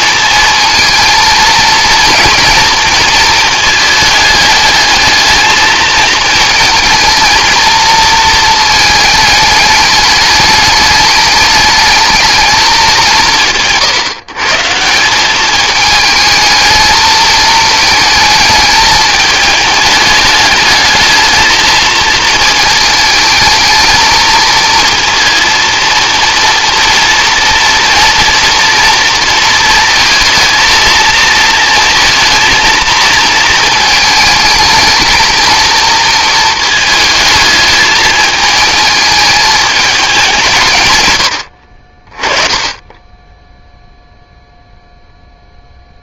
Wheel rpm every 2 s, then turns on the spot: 220, 230, 210, 220, 220, 210, 210, 140, 220, 220, 210, 220, 230, 240, 230, 230, 230, 210, 220, 220, 170, 20, 0.
none